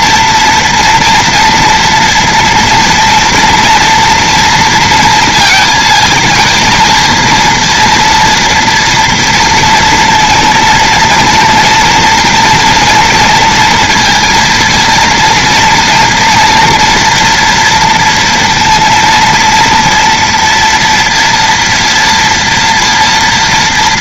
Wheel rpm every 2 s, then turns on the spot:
230, 230, 230, 230, 230, 230, 230, 230, 240, 230, 230, 230.
none